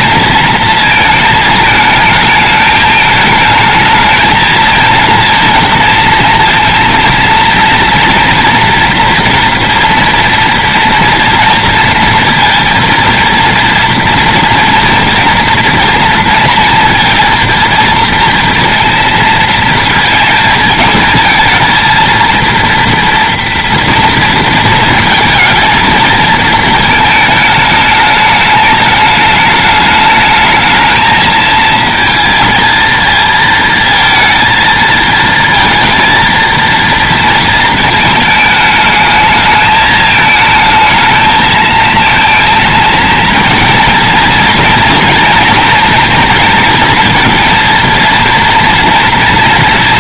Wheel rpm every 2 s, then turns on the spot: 220, 210, 230, 230, 240, 230, 230, 230, 230, 230, 220, 230, 230, 220, 210, 220, 220, 220, 230, 220, 220, 230, 230, 230, 230.
none